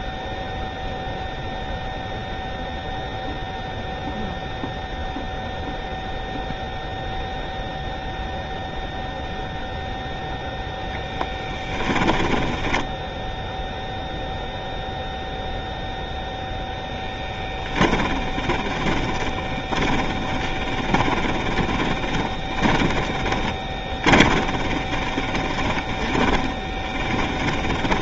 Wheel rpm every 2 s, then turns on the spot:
0, 0, 0, 0, 0, 0, 10, 0, 0, 20, 20, 10, 20, 10.
12-14 18-28